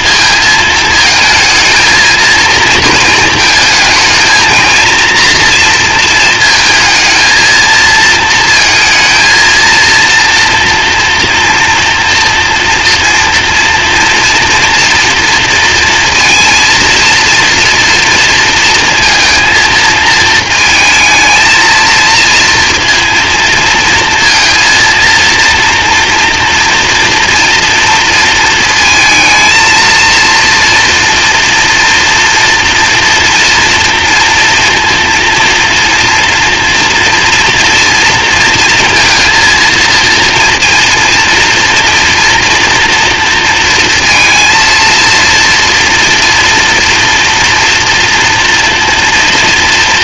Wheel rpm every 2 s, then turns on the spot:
220, 230, 230, 220, 230, 230, 230, 230, 230, 230, 220, 230, 230, 240, 230, 230, 230, 230, 230, 230, 230, 230, 230, 230, 230.
none